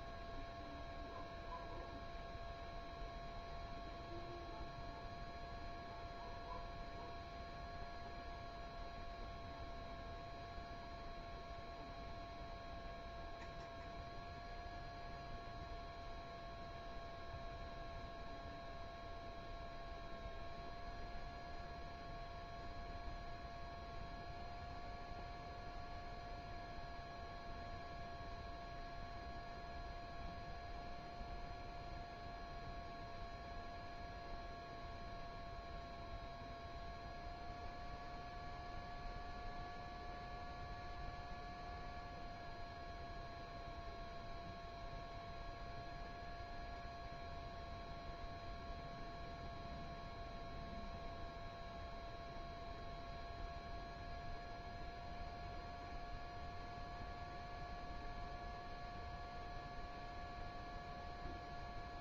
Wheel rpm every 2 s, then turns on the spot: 0, 0, 0, 0, 0, 0, 0, 0, 0, 0, 0, 0, 0, 0, 0, 0, 0, 0, 0, 0, 0, 0, 0, 0, 0, 0, 0, 0, 0, 0, 0.
none